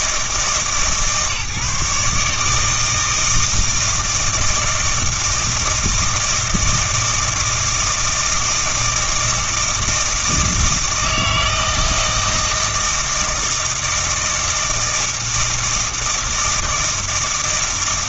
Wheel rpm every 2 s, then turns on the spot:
150, 150, 160, 160, 160, 160, 160, 160, 160.
none